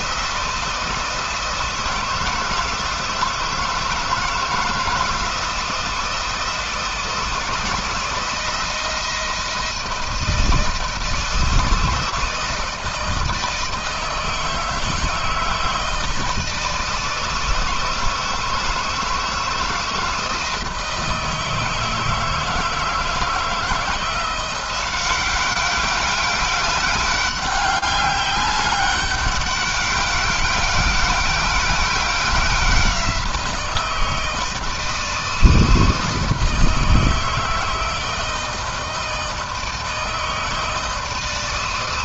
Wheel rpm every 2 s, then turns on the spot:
160, 170, 160, 160, 160, 160, 160, 160, 160, 160, 160, 160, 180, 200, 200, 190, 180, 160, 160, 160, 160.
none